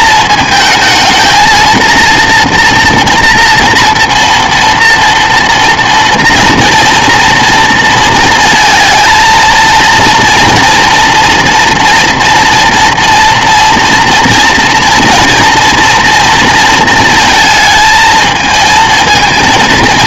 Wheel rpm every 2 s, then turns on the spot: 220, 230, 230, 230, 220, 230, 230, 230, 230, 220.
none